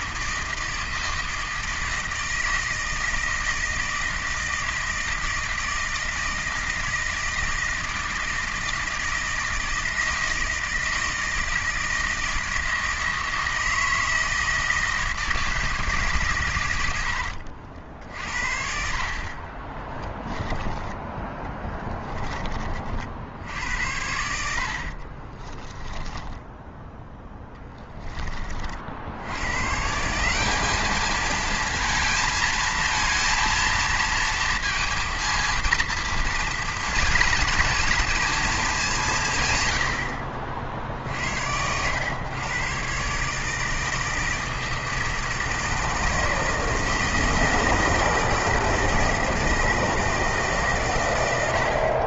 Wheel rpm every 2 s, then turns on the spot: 160, 160, 160, 160, 160, 160, 160, 160, 110, 50, 20, 30, 70, 10, 30, 200, 230, 230, 230, 210, 50, 120, 160, 160, 160, 160.
20-22 26-28